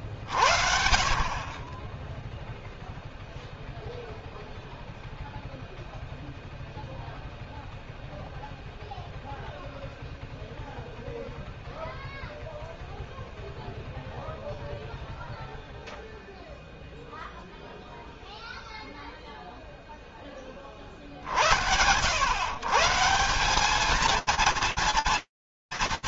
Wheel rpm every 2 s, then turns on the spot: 10, 0, 0, 0, 0, 0, 0, 0, 0, 0, 30, 130, 210.
none